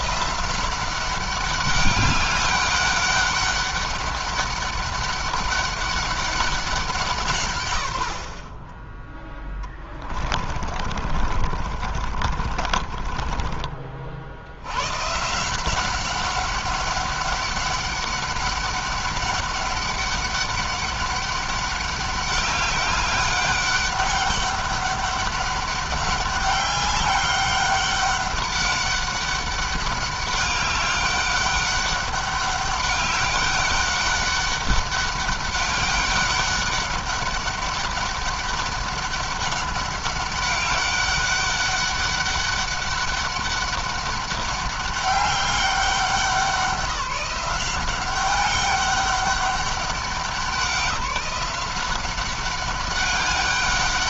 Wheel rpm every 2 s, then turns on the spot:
190, 200, 200, 180, 30, 50, 30, 100, 190, 200, 200, 200, 200, 200, 200, 200, 200, 200, 200, 200, 200, 200, 200, 180, 200, 190, 190.
10-14